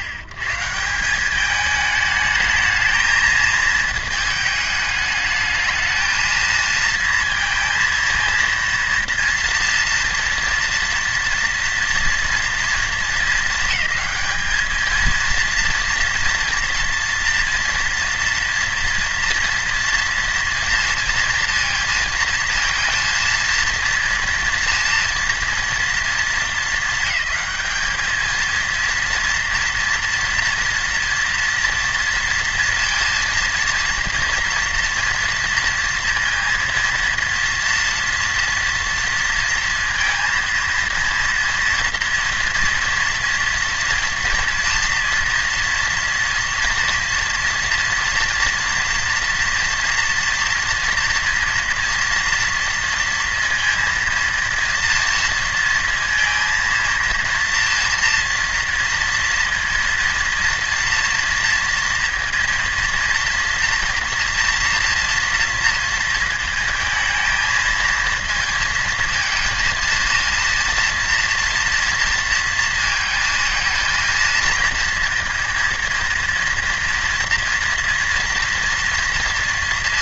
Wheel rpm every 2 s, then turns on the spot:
140, 220, 220, 220, 230, 230, 230, 210, 230, 230, 230, 230, 230, 220, 230, 230, 230, 230, 230, 230, 230, 230, 230, 230, 240, 230, 230, 230, 230, 230, 230, 230, 240, 220, 230, 230, 230, 230, 230, 230.
none